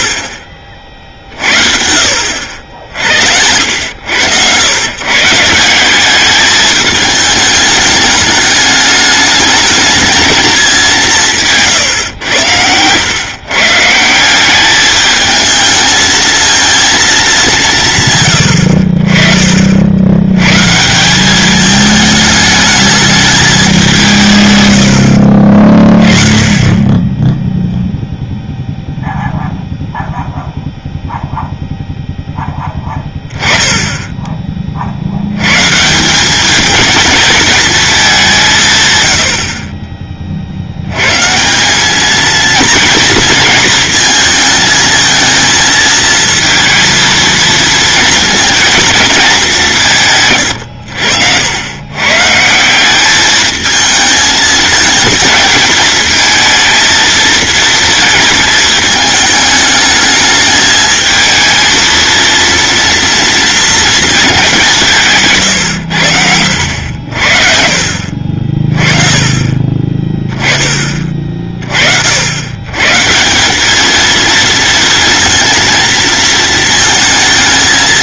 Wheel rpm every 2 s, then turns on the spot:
50, 70, 120, 210, 210, 200, 110, 200, 230, 70, 150, 210, 110, 20, 0, 0, 20, 50, 210, 140, 80, 230, 220, 230, 230, 90, 180, 220, 230, 220, 220, 230, 170, 70, 40, 20, 140, 230, 230.
50-52